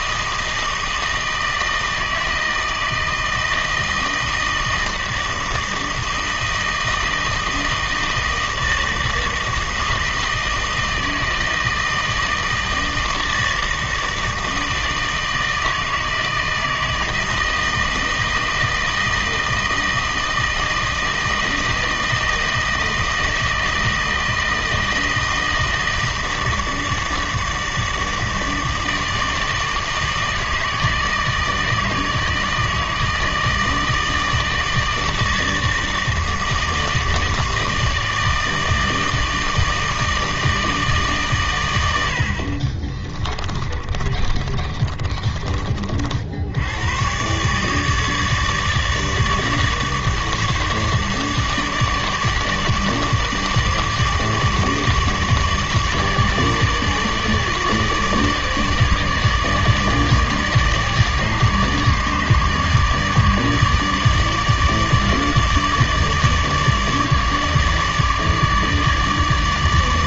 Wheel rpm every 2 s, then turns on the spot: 160, 160, 160, 160, 160, 160, 160, 160, 160, 160, 160, 160, 160, 160, 160, 160, 160, 160, 160, 160, 160, 50, 30, 90, 150, 150, 150, 150, 150, 150, 150, 150, 150, 150, 150.
42-46